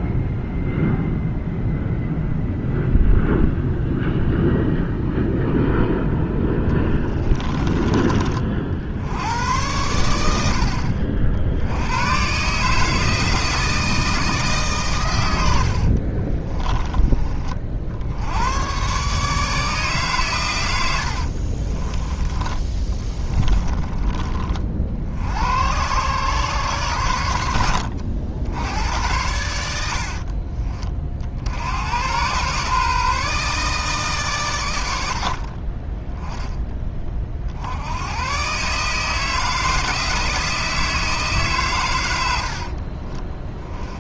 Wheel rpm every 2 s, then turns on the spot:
0, 0, 0, 20, 80, 70, 150, 120, 20, 130, 80, 20, 60, 110, 90, 40, 140, 90, 20, 150, 160, 30.
6-8 20-24 42-44